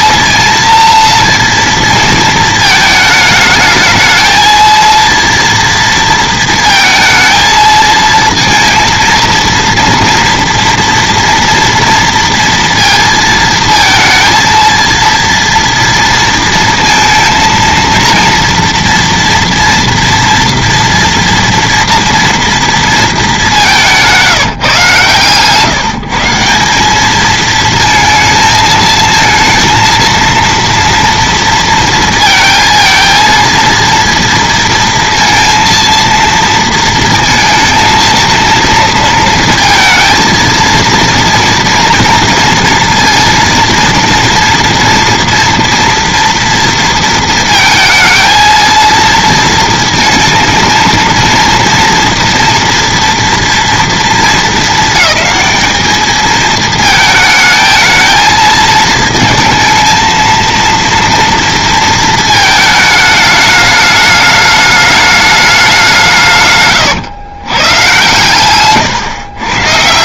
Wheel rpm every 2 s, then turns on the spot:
230, 220, 220, 230, 230, 230, 230, 230, 230, 230, 230, 230, 160, 180, 220, 230, 230, 230, 230, 230, 230, 230, 230, 230, 230, 230, 230, 220, 220, 230, 230, 220, 210, 140, 120.
68-70